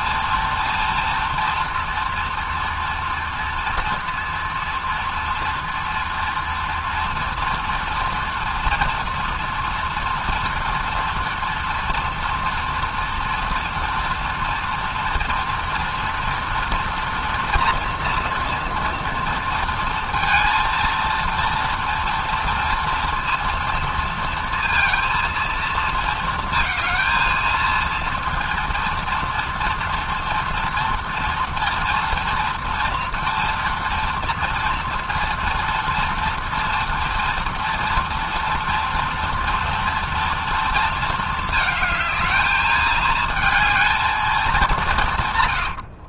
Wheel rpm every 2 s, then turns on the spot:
230, 230, 230, 240, 230, 230, 230, 230, 230, 230, 230, 230, 230, 220, 230, 230, 230, 230, 230, 230, 220, 220, 110.
44-46